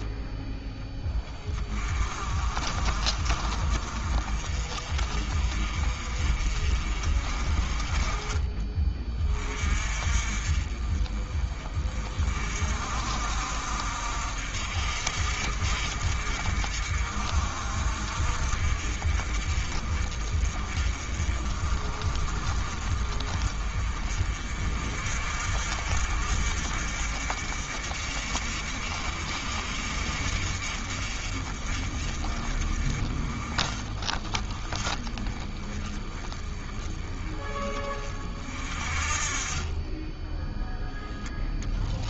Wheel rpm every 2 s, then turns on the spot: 10, 40, 40, 40, 20, 30, 50, 60, 50, 50, 40, 40, 50, 60, 50, 50, 40, 20, 20, 40, 0.
none